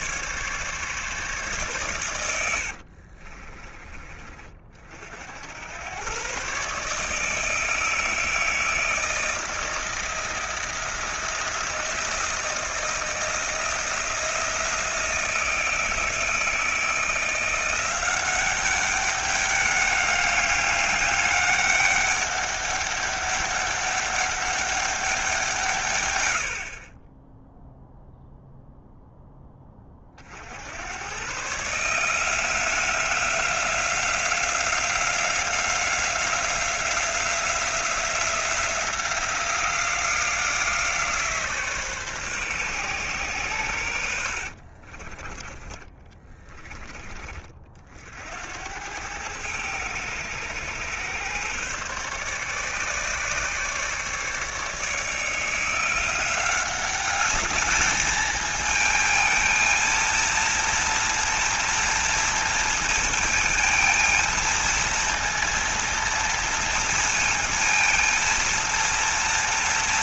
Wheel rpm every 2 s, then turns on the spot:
140, 60, 50, 150, 160, 160, 160, 160, 170, 200, 200, 200, 200, 40, 0, 90, 180, 180, 180, 180, 160, 130, 40, 20, 90, 110, 140, 150, 190, 220, 230, 230, 230, 230, 230.
2-4 44-46